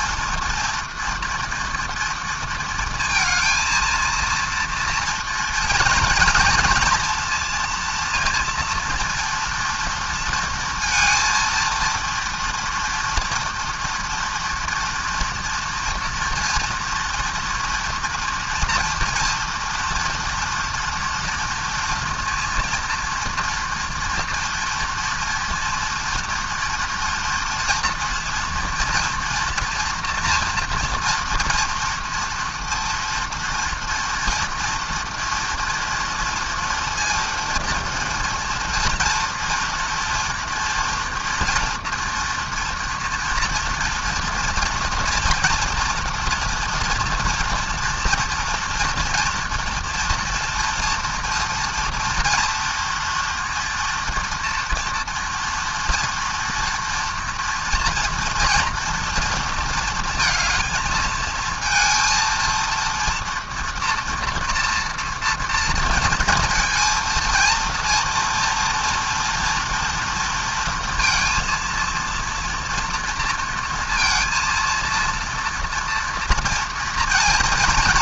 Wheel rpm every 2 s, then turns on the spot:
240, 230, 240, 230, 230, 230, 230, 230, 230, 230, 230, 230, 230, 230, 230, 230, 230, 230, 230, 230, 240, 230, 240, 230, 230, 230, 230, 230, 230, 230, 220, 230, 230, 230, 230, 230, 230, 230, 230.
none